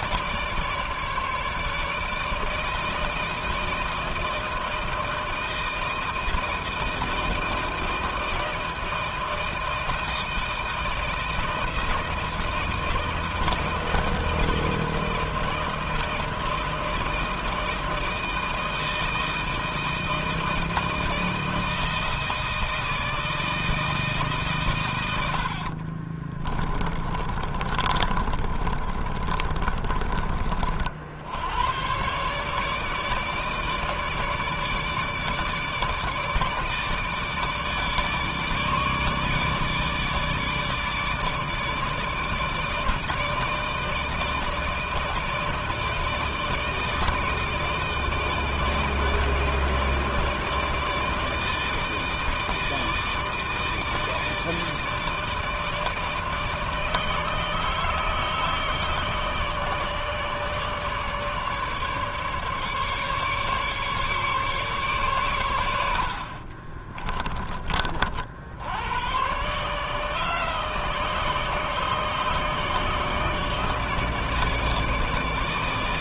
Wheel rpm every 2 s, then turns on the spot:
150, 160, 160, 160, 160, 170, 160, 160, 160, 160, 160, 160, 110, 20, 30, 70, 150, 150, 150, 150, 150, 160, 160, 160, 160, 160, 160, 160, 160, 160, 150, 140, 130, 30, 100, 160, 150, 150.
26-30 66-68